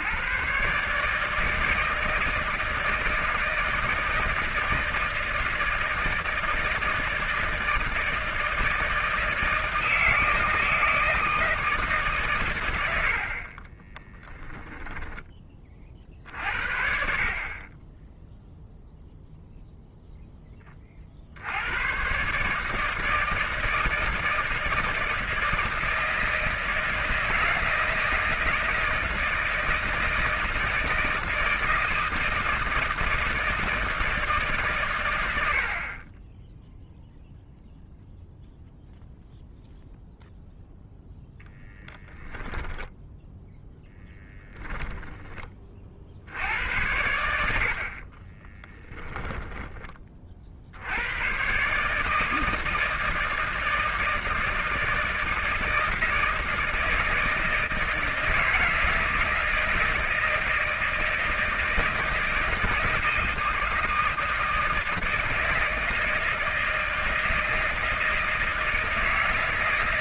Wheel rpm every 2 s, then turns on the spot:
120, 160, 160, 160, 160, 160, 110, 10, 50, 0, 20, 150, 160, 160, 160, 160, 160, 130, 0, 0, 0, 10, 10, 80, 20, 60, 160, 160, 160, 160, 160, 160, 160, 160, 160.
14-16 42-44 48-50